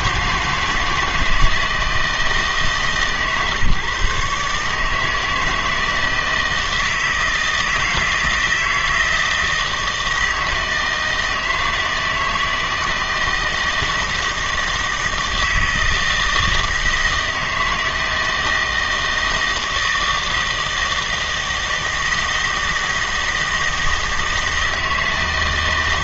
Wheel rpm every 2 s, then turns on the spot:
160, 150, 150, 160, 160, 160, 160, 160, 160, 160, 160, 160, 160.
none